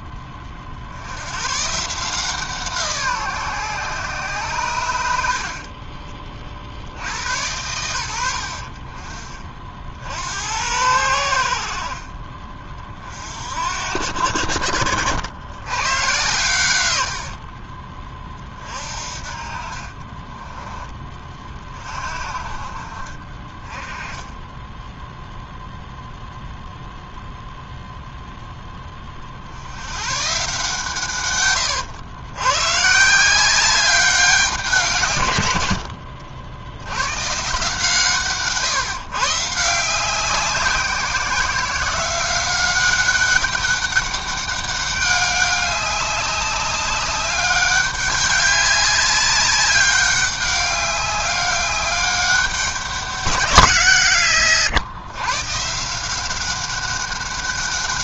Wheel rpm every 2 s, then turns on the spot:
50, 160, 110, 50, 50, 90, 40, 70, 100, 40, 20, 40, 10, 0, 10, 140, 120, 170, 90, 140, 180, 190, 200, 200, 190, 200, 200, 130, 190.
24-26